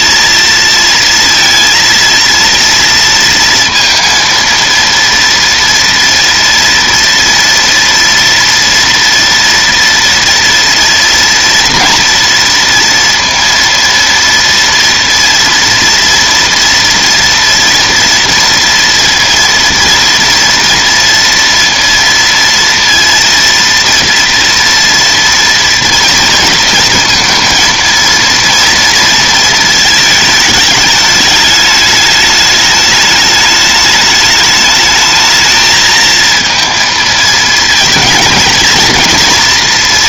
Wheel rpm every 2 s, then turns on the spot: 230, 230, 230, 230, 230, 230, 230, 230, 230, 230, 230, 230, 230, 230, 230, 210, 210, 210, 230, 230.
none